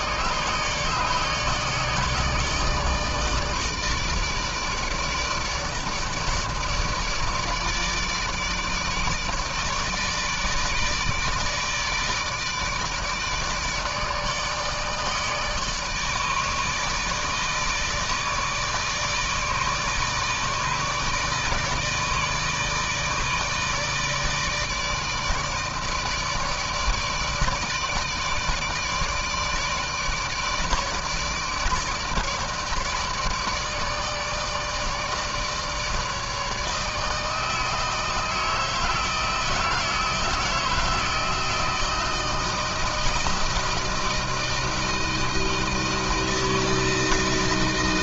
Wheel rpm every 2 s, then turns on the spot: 150, 160, 150, 160, 150, 160, 160, 150, 150, 160, 160, 160, 160, 160, 150, 160, 150, 150, 150, 160, 160, 160, 160, 160.
none